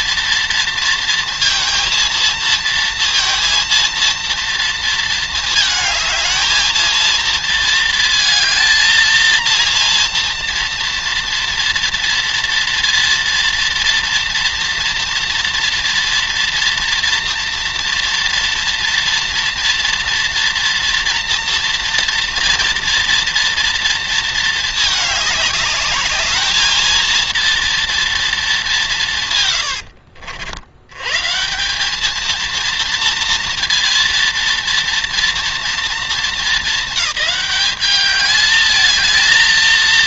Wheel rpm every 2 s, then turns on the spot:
230, 230, 230, 220, 230, 240, 230, 230, 230, 230, 240, 240, 220, 220, 210, 80, 230, 230, 210, 210.
none